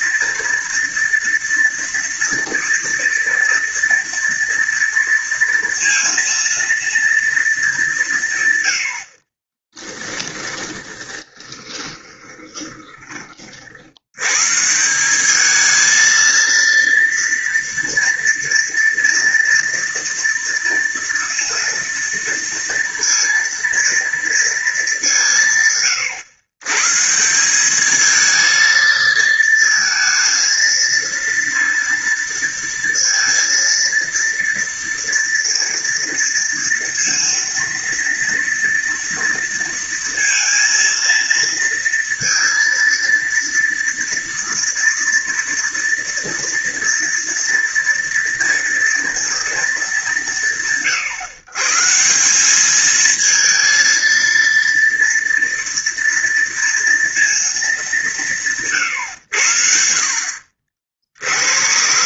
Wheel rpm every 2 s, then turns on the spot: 230, 230, 230, 230, 90, 10, 20, 160, 230, 230, 230, 230, 220, 130, 230, 230, 230, 230, 230, 230, 230, 230, 230, 230, 230, 130, 210, 230, 230, 140, 60.
10-14